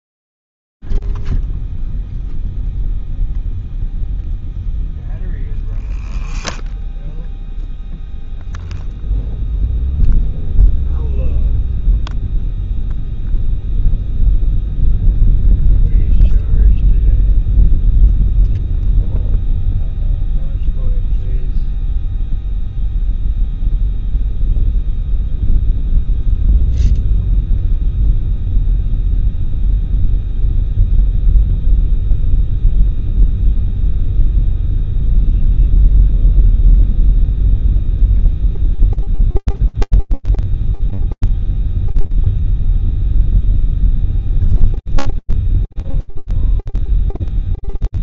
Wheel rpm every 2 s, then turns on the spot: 0, 0, 0, 0, 0, 0, 0, 0, 0, 0, 0, 0, 0, 0, 0, 0, 0, 0, 0, 0, 0, 0, 0, 0.
none